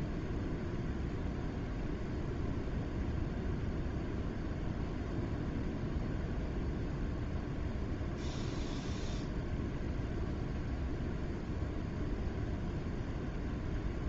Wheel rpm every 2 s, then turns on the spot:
0, 0, 0, 0, 0, 0, 0.
none